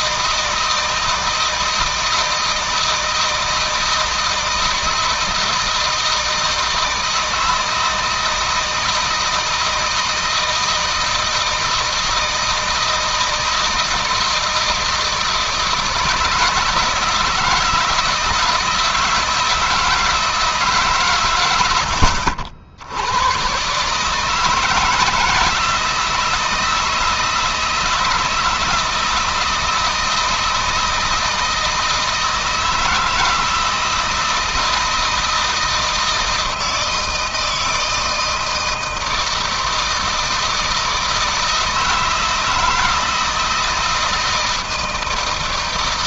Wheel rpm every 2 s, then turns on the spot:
160, 160, 160, 160, 160, 160, 160, 160, 170, 160, 130, 80, 160, 160, 160, 160, 160, 160, 160, 160, 160, 160, 160.
none